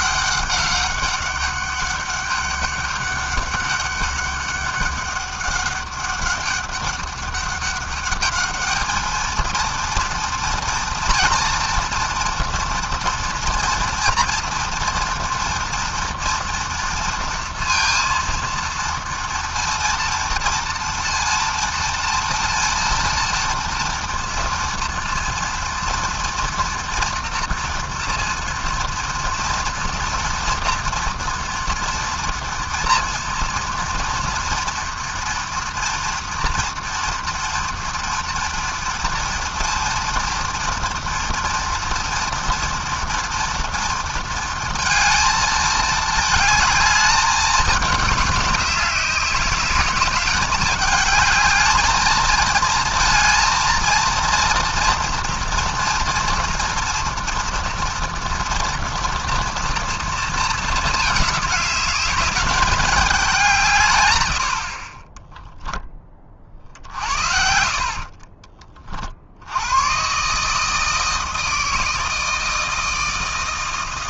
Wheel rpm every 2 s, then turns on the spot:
200, 200, 200, 200, 220, 230, 230, 230, 230, 230, 230, 230, 230, 240, 230, 240, 230, 230, 230, 230, 230, 230, 220, 210, 200, 220, 230, 230, 230, 230, 210, 190, 10, 60, 50, 160, 160.
none